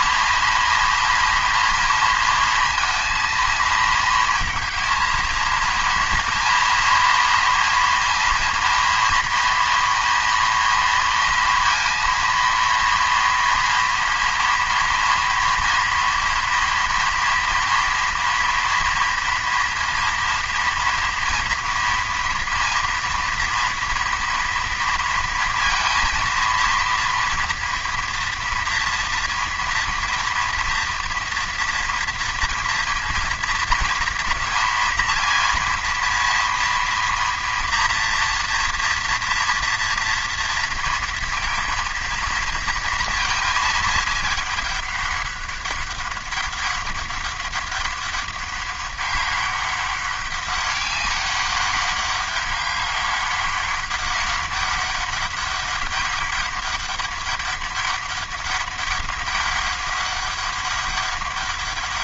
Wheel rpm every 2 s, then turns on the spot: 230, 230, 230, 240, 240, 230, 230, 230, 230, 230, 230, 230, 230, 230, 230, 230, 230, 230, 230, 230, 230, 230, 210, 200, 200, 200, 200, 200, 200, 200, 200.
none